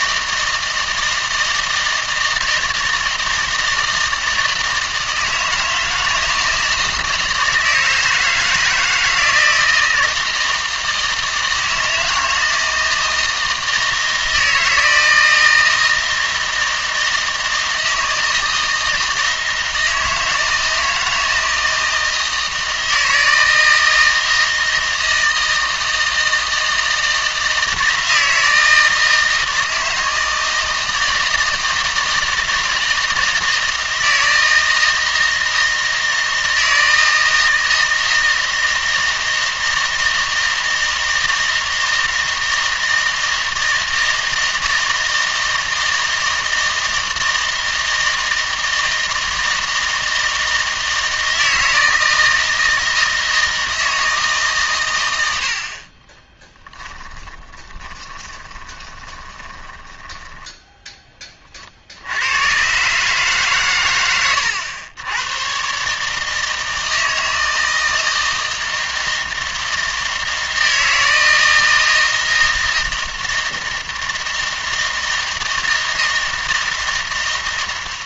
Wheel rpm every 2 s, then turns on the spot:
160, 160, 160, 160, 160, 160, 160, 160, 160, 160, 160, 160, 160, 160, 160, 160, 160, 160, 160, 160, 160, 160, 160, 160, 160, 160, 160, 130, 20, 20, 10, 130, 100, 160, 160, 160, 160, 160, 160.
56-62